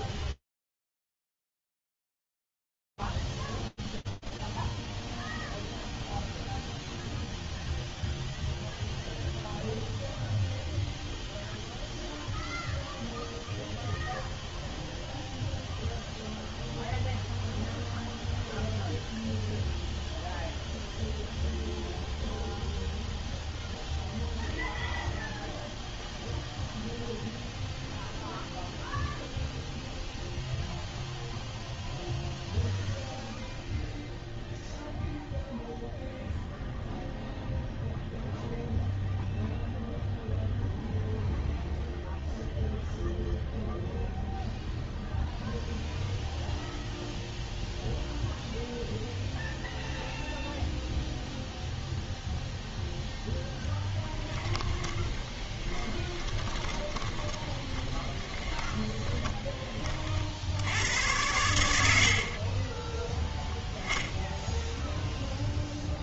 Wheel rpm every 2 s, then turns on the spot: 0, 0, 0, 0, 0, 0, 0, 0, 0, 0, 0, 0, 0, 0, 0, 0, 0, 0, 0, 0, 0, 0, 0, 0, 0, 0, 0, 20, 20, 20, 90, 10, 0.
54-62